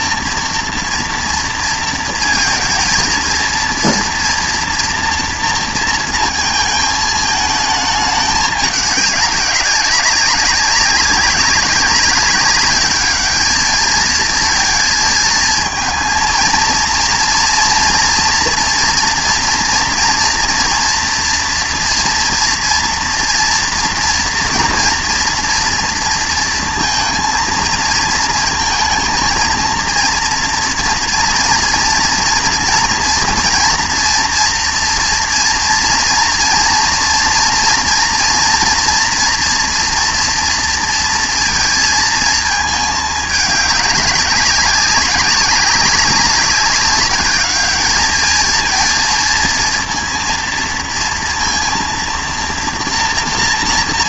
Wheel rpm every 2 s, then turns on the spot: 240, 220, 230, 230, 200, 200, 200, 230, 230, 230, 230, 230, 230, 230, 230, 240, 230, 230, 230, 230, 230, 220, 200, 200, 220, 230, 230.
none